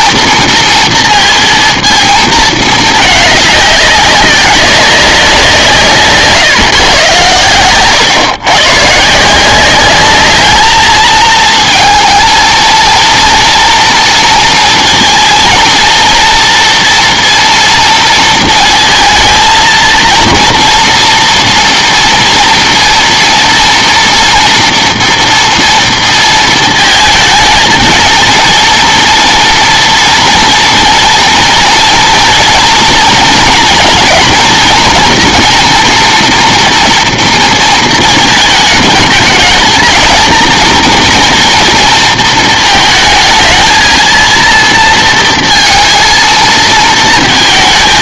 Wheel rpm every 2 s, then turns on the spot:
230, 210, 190, 140, 130, 210, 230, 230, 230, 230, 230, 230, 230, 220, 230, 230, 230, 230, 230, 220, 230, 220, 230, 230.
none